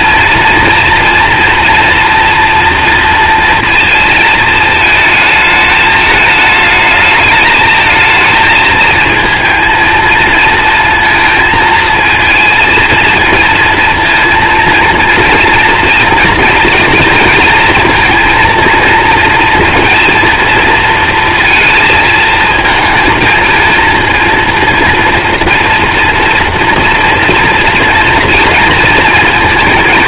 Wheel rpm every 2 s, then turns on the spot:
230, 230, 220, 210, 220, 230, 230, 230, 230, 230, 230, 220, 230, 240, 230.
none